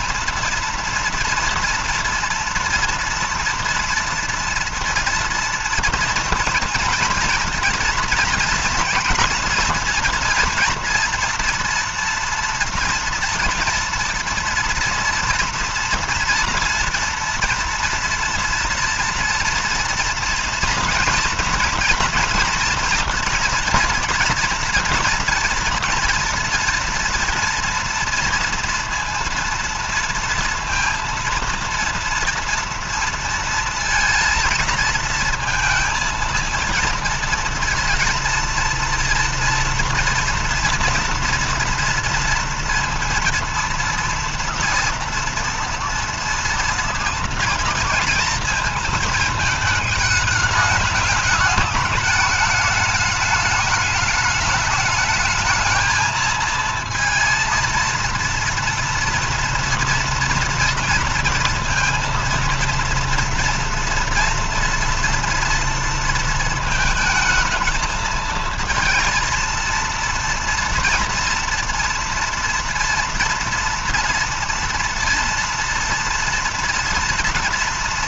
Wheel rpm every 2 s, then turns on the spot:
230, 230, 230, 230, 230, 230, 230, 230, 230, 230, 230, 230, 230, 240, 230, 230, 230, 230, 230, 230, 230, 230, 230, 230, 230, 210, 210, 210, 220, 230, 240, 230, 230, 220, 230, 230, 230, 230, 230.
none